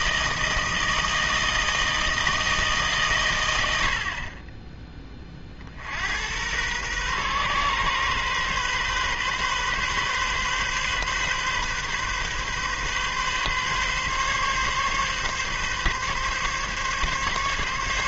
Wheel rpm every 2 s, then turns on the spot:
160, 150, 20, 120, 130, 130, 130, 140, 140.
none